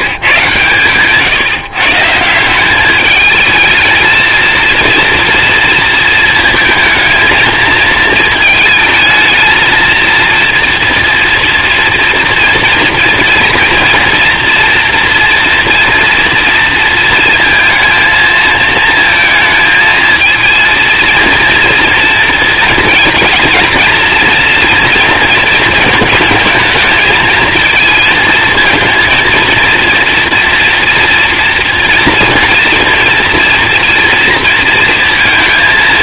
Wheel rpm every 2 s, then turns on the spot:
140, 220, 230, 230, 230, 240, 230, 240, 230, 220, 230, 230, 230, 220, 230, 230, 230, 230.
none